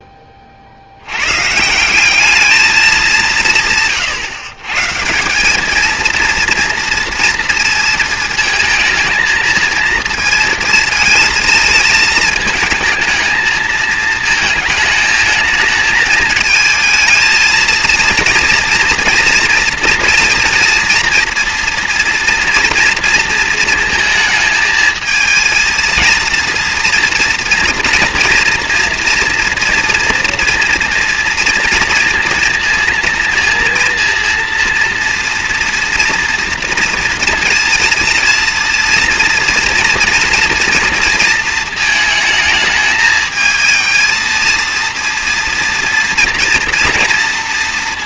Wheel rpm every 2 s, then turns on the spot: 40, 220, 130, 230, 220, 220, 220, 220, 220, 230, 230, 230, 220, 230, 230, 230, 230, 230, 230, 230, 230, 220, 230, 230.
none